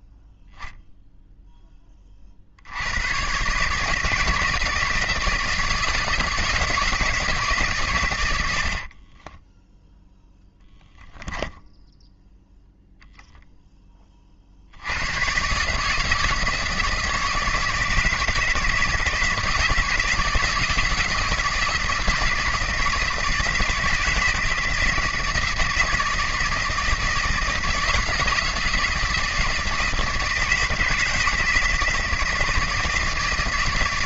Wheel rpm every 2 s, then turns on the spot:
0, 80, 160, 160, 60, 10, 0, 70, 160, 170, 160, 160, 160, 160, 160, 160, 160.
8-10